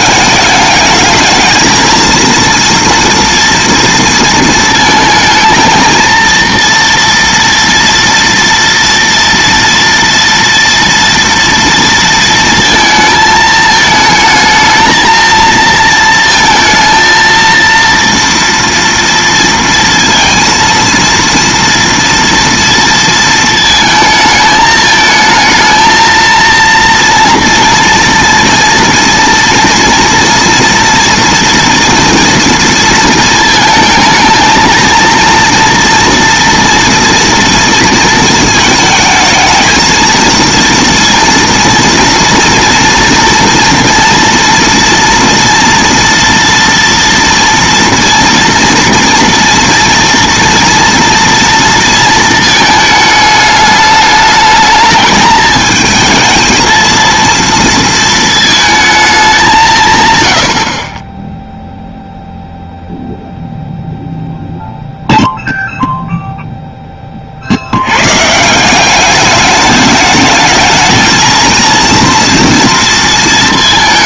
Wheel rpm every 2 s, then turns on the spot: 210, 230, 230, 230, 230, 230, 230, 220, 230, 230, 230, 230, 220, 230, 230, 230, 230, 230, 230, 220, 230, 230, 230, 230, 230, 230, 220, 210, 220, 220, 70, 0, 0, 0, 170, 220, 230.
none